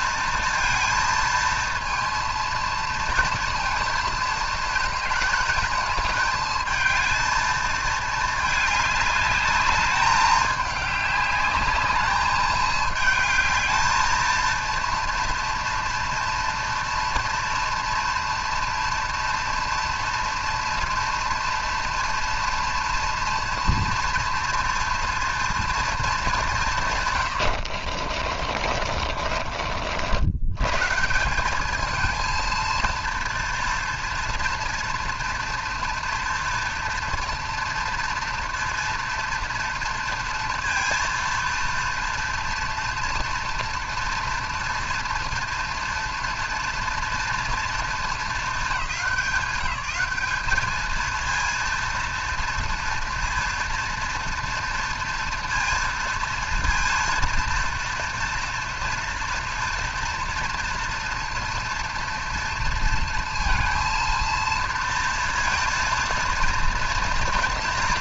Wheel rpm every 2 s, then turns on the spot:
230, 230, 220, 220, 210, 210, 210, 230, 230, 240, 240, 240, 230, 190, 40, 100, 230, 230, 230, 230, 230, 230, 230, 230, 210, 210, 230, 230, 230, 230, 230, 230, 230, 230.
28-30